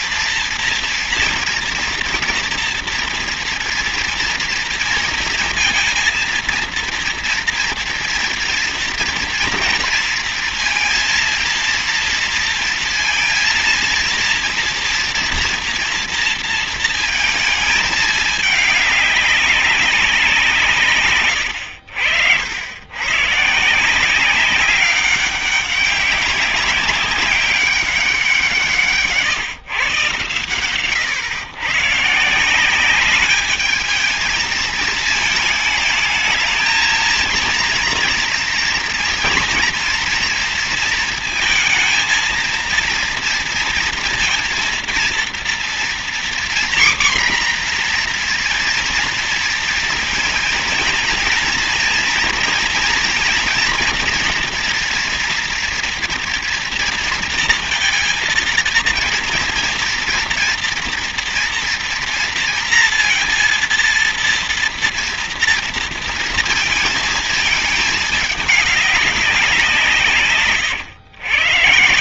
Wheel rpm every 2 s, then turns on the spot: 230, 240, 230, 230, 240, 230, 230, 230, 230, 210, 170, 90, 190, 200, 170, 110, 170, 220, 220, 230, 230, 230, 230, 240, 240, 220, 230, 230, 230, 230, 240, 230, 230, 230, 200, 140.
none